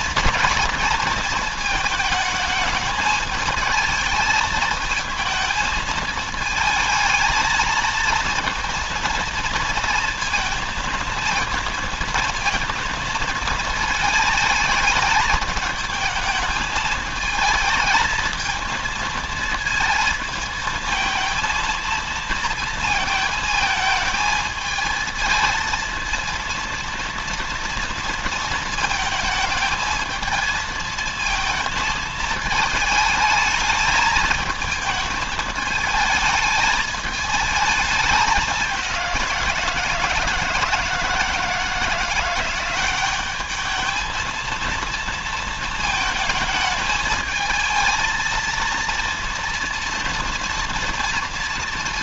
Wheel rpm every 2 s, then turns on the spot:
230, 220, 220, 220, 230, 230, 230, 220, 220, 230, 230, 220, 220, 230, 220, 220, 220, 220, 220, 190, 160, 190, 230, 220, 230, 230.
none